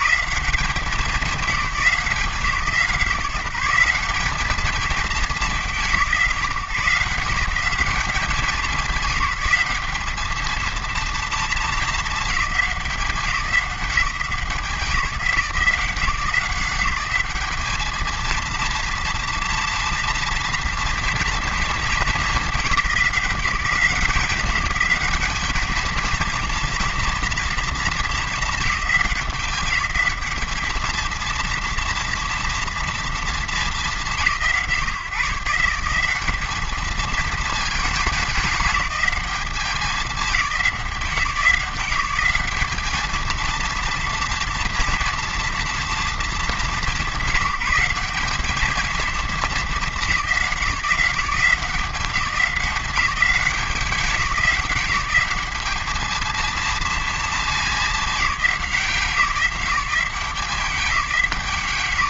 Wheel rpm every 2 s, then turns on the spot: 180, 180, 210, 150, 190, 230, 200, 160, 180, 230, 230, 200, 190, 230, 210, 220, 230, 150, 210, 210, 180, 210, 230, 190, 210, 190, 190, 190, 230, 190, 190.
none